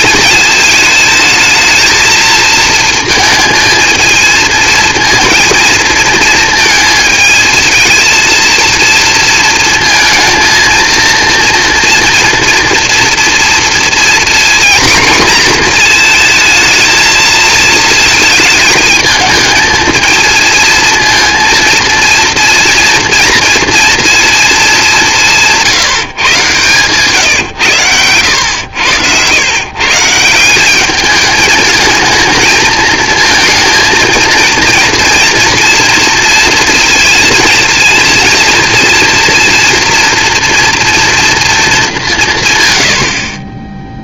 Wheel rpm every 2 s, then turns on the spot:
220, 230, 230, 220, 230, 230, 230, 240, 220, 220, 230, 230, 200, 130, 100, 200, 230, 230, 230, 230, 230, 170.
none